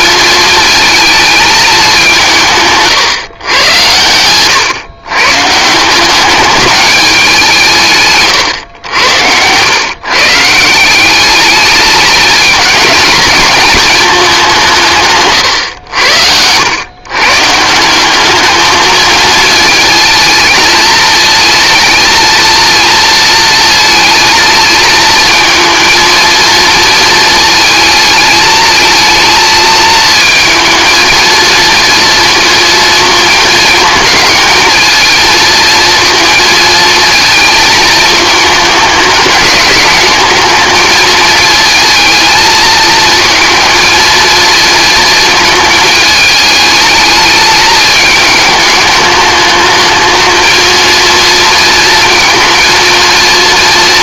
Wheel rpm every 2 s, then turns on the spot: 220, 170, 110, 200, 110, 160, 220, 180, 90, 210, 220, 230, 220, 230, 220, 220, 220, 220, 220, 210, 210, 220, 230, 220, 210, 220, 230.
8-10